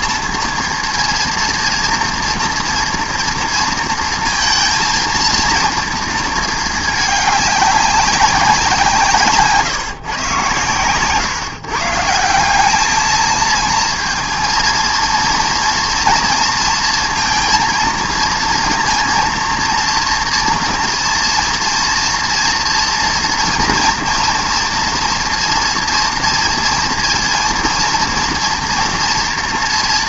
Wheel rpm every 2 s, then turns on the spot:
230, 230, 230, 220, 170, 110, 190, 220, 230, 230, 230, 230, 230, 230, 230.
none